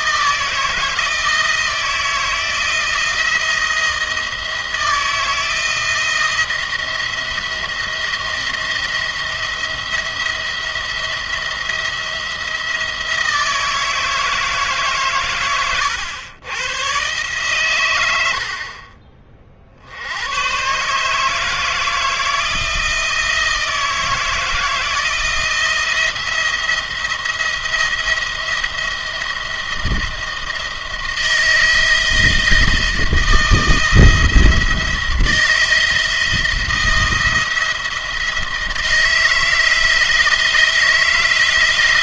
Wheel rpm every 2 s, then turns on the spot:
160, 170, 170, 170, 170, 170, 170, 140, 120, 50, 130, 170, 160, 170, 170, 160, 170, 170, 170, 160, 160.
none